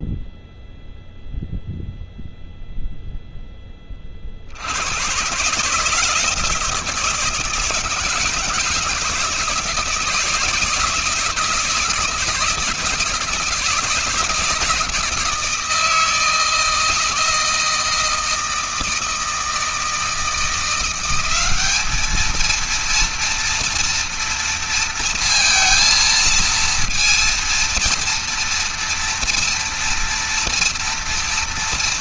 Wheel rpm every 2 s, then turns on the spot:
0, 0, 90, 160, 160, 160, 160, 160, 160, 160, 170, 230, 230, 230, 230, 230.
none